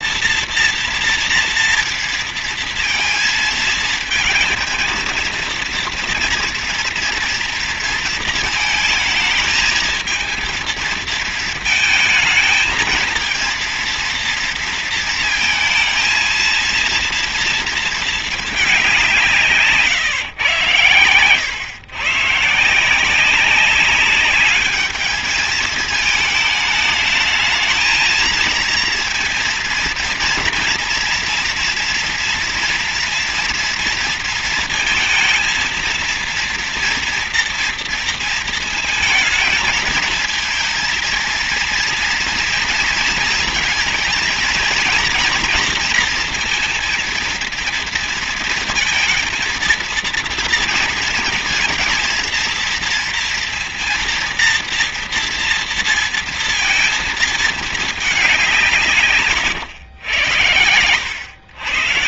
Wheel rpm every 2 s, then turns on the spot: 230, 230, 230, 230, 220, 220, 220, 230, 230, 210, 120, 150, 200, 220, 230, 230, 230, 220, 230, 230, 230, 230, 220, 230, 230, 230, 230, 230, 230, 180, 100.
60-62